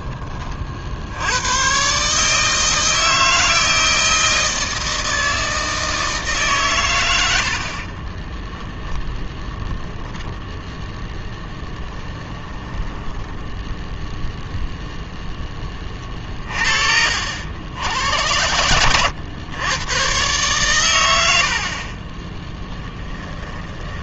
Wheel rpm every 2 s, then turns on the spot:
60, 160, 160, 120, 10, 0, 10, 0, 50, 90, 110, 10.
12-14 22-24